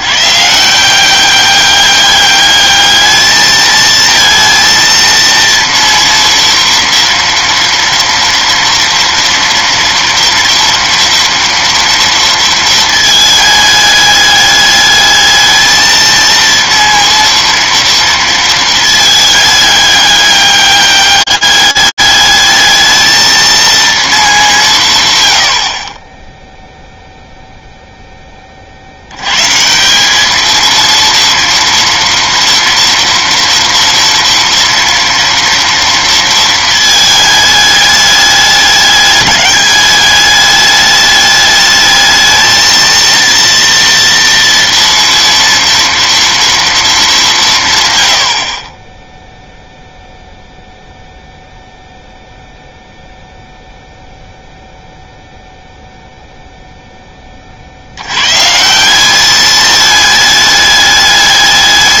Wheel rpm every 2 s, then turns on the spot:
160, 210, 230, 230, 230, 230, 220, 210, 230, 220, 200, 220, 150, 0, 70, 230, 230, 230, 220, 200, 210, 230, 230, 220, 10, 0, 0, 0, 10, 180, 210.
none